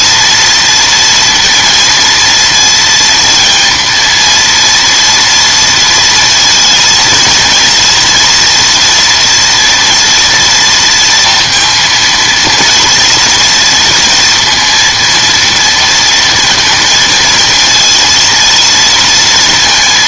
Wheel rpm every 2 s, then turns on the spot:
230, 230, 230, 230, 240, 230, 230, 230, 230, 230.
none